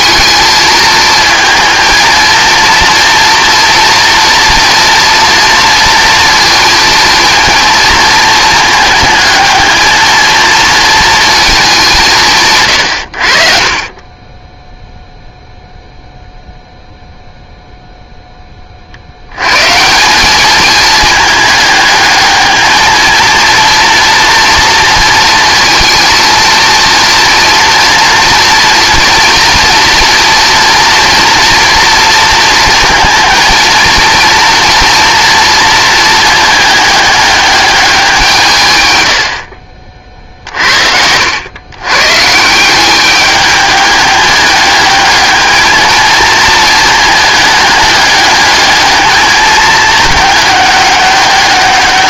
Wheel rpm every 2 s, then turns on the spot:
220, 230, 230, 230, 220, 230, 130, 10, 0, 40, 220, 220, 230, 230, 230, 240, 230, 230, 210, 130, 60, 180, 210, 220, 210, 200.
40-42